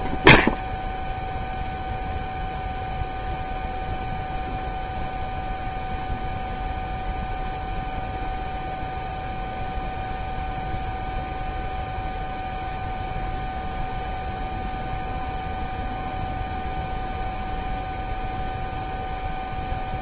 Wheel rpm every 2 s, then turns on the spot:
0, 0, 0, 0, 0, 0, 0, 0, 0, 0.
none